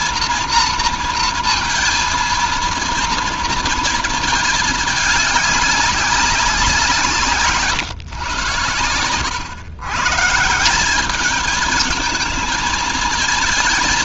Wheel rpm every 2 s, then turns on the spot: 230, 230, 220, 190, 120, 180, 230.
none